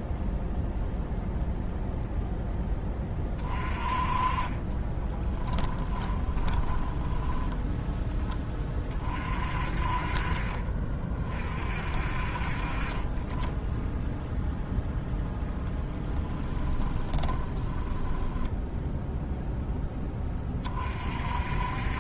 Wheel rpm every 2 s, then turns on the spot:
0, 10, 30, 20, 30, 40, 40, 0, 10, 10, 30.
4-8 16-20